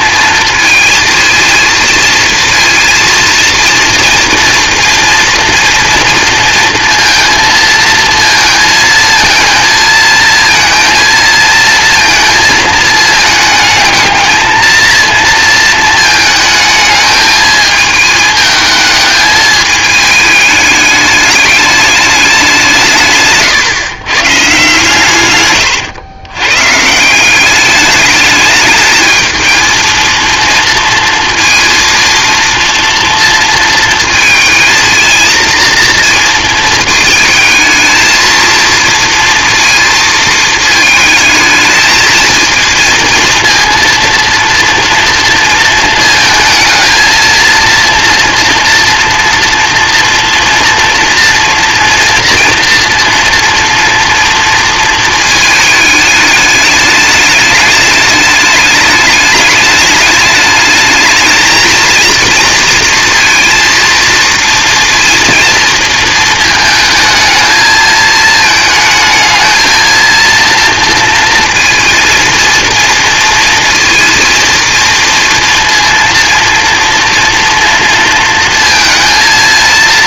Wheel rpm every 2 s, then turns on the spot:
230, 230, 230, 230, 230, 230, 220, 230, 220, 220, 210, 170, 140, 140, 220, 230, 230, 220, 230, 230, 220, 230, 230, 220, 230, 240, 230, 230, 210, 210, 210, 230, 230, 220, 220, 230, 230, 230, 230, 230.
none